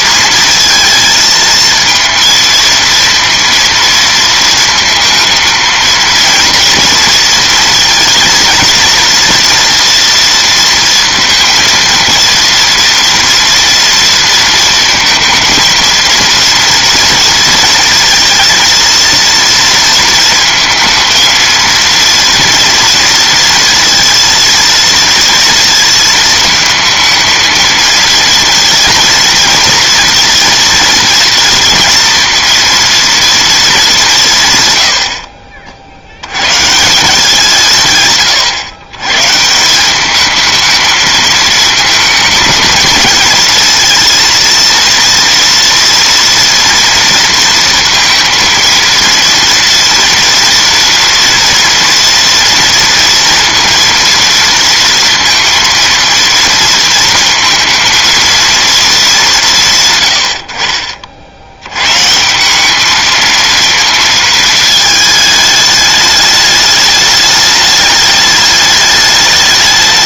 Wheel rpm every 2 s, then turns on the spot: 230, 230, 230, 230, 230, 230, 230, 230, 230, 230, 220, 230, 230, 220, 230, 230, 230, 120, 150, 120, 220, 220, 230, 230, 230, 240, 230, 230, 230, 210, 70, 200, 220, 210, 210.
none